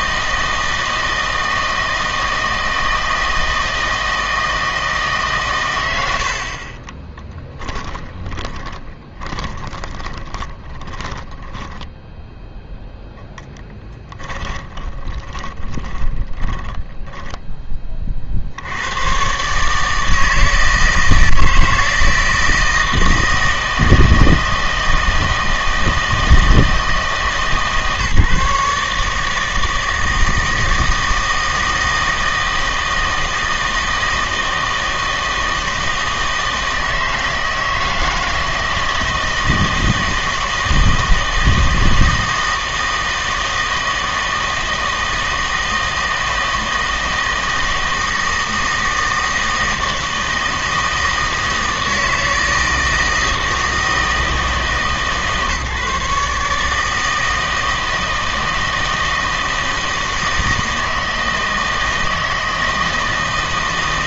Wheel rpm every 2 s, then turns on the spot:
160, 160, 160, 40, 20, 20, 0, 20, 20, 90, 160, 160, 160, 160, 150, 160, 160, 160, 160, 160, 160, 160, 160, 160, 160, 160, 160, 160, 160, 160, 160, 160.
8-12 14-18